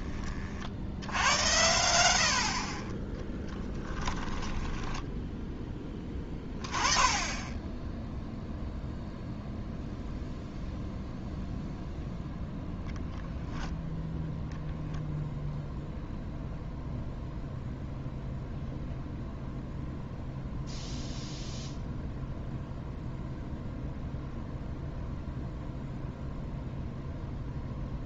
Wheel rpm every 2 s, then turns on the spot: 60, 40, 10, 20, 0, 0, 0, 0, 0, 0, 0, 0, 0, 0.
4-6